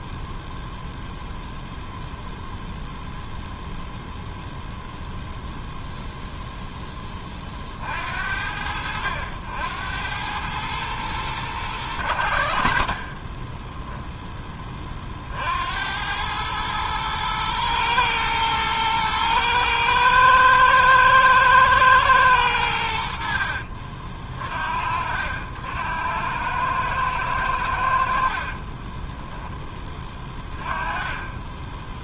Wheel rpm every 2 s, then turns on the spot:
0, 0, 0, 10, 80, 110, 40, 20, 110, 110, 110, 90, 50, 110, 20, 20.
28-30